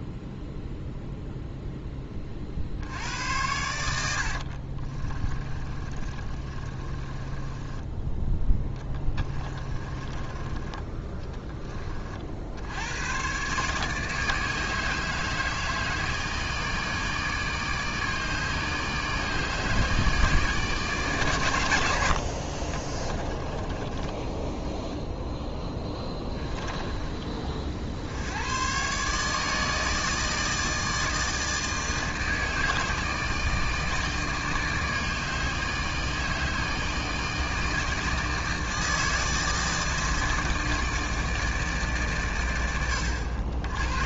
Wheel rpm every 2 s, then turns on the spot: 0, 60, 40, 30, 10, 20, 80, 150, 150, 150, 150, 30, 0, 10, 120, 160, 160, 160, 160, 160, 160, 90.
4-10 22-24 26-28